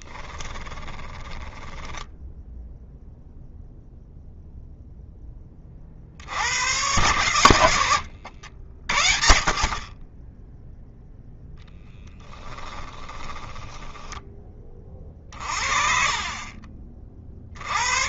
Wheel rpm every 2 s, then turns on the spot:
10, 0, 0, 100, 50, 10, 10, 30, 40.
0-2 12-14